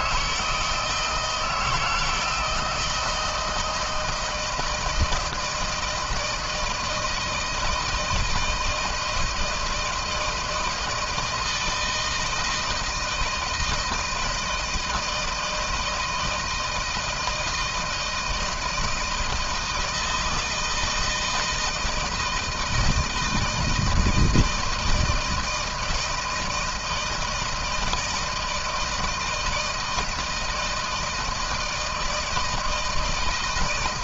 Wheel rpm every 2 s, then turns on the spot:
160, 160, 160, 160, 160, 160, 160, 160, 160, 160, 160, 160, 160, 160, 160, 160, 160.
none